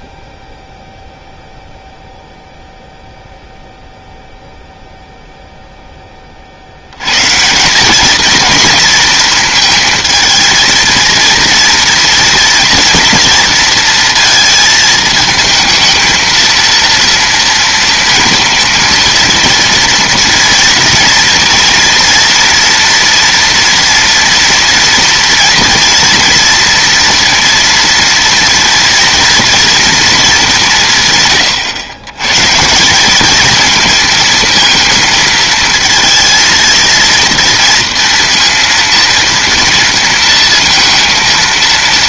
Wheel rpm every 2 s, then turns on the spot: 0, 0, 0, 60, 220, 220, 230, 220, 230, 230, 230, 230, 230, 230, 230, 180, 150, 230, 230, 230, 230.
none